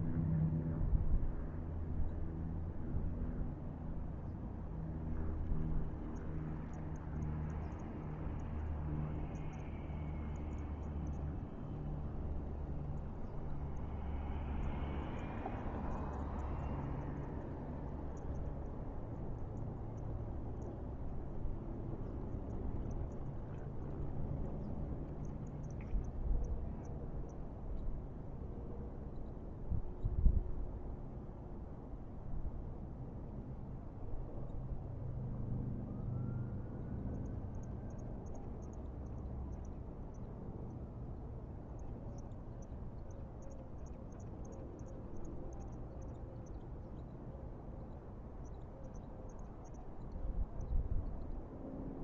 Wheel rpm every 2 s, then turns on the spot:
0, 0, 0, 0, 0, 0, 0, 0, 0, 0, 0, 0, 0, 0, 0, 0, 0, 0, 0, 0, 0, 0, 0, 0, 0, 0.
none